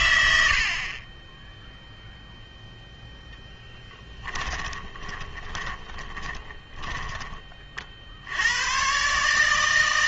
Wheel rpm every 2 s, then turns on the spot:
60, 0, 20, 20, 110.
4-8